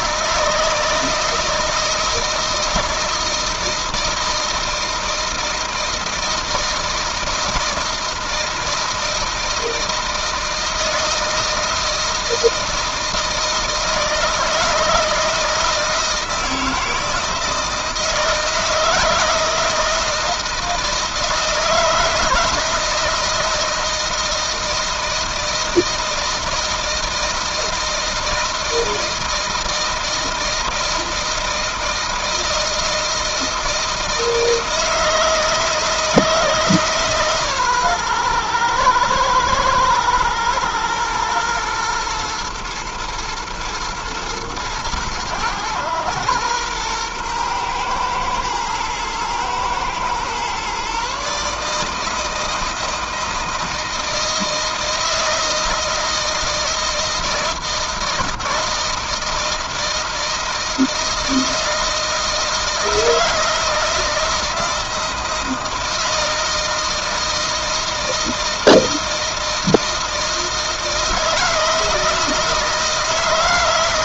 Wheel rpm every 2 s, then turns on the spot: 160, 160, 160, 160, 160, 160, 160, 160, 160, 160, 160, 160, 160, 160, 160, 170, 160, 160, 160, 120, 120, 110, 110, 110, 110, 120, 160, 160, 160, 160, 160, 160, 160, 160, 160, 160, 160.
none